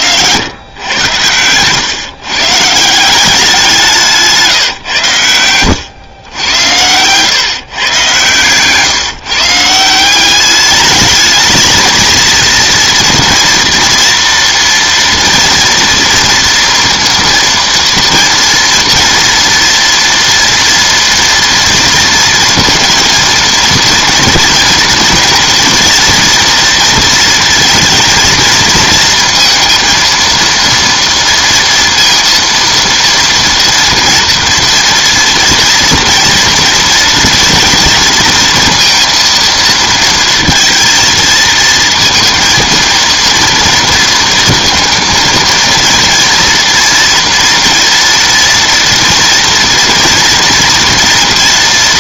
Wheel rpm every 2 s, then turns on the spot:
100, 140, 150, 100, 130, 200, 230, 230, 230, 230, 230, 230, 230, 230, 230, 230, 230, 230, 230, 230, 230, 230, 230, 230, 230, 230.
8-10